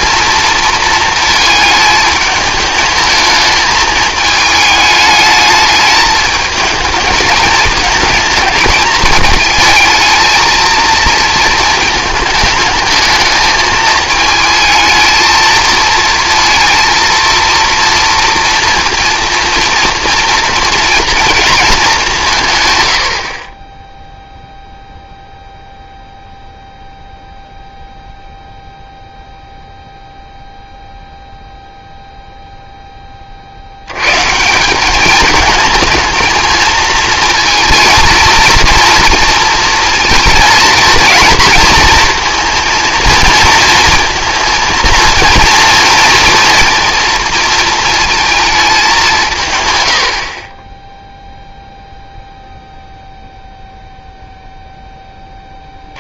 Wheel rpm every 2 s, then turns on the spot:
230, 210, 210, 220, 220, 220, 220, 220, 230, 230, 230, 130, 0, 0, 0, 0, 0, 180, 220, 230, 230, 230, 230, 230, 210, 20, 0, 0.
none